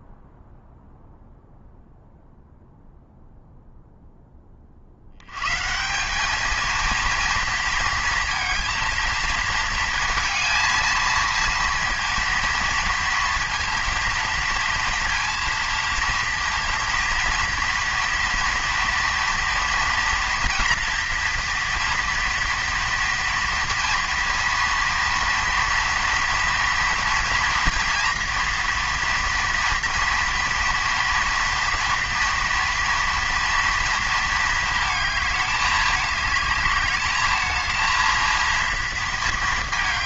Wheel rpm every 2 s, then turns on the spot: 0, 0, 90, 230, 230, 230, 230, 230, 230, 230, 230, 230, 240, 230, 230, 230, 230, 210, 220, 230.
none